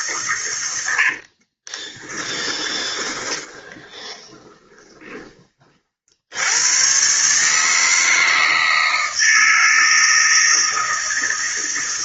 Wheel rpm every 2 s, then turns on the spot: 70, 20, 30, 140, 160, 160.
0-4